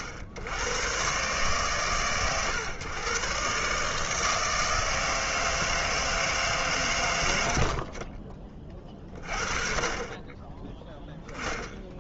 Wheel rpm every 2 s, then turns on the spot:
90, 110, 160, 140, 20, 10.
none